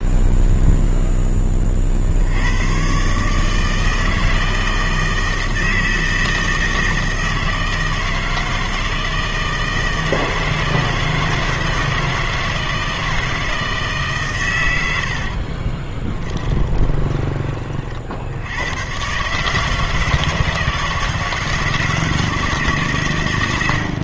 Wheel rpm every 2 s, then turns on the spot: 0, 110, 160, 160, 160, 160, 160, 110, 20, 100, 160, 150.
16-18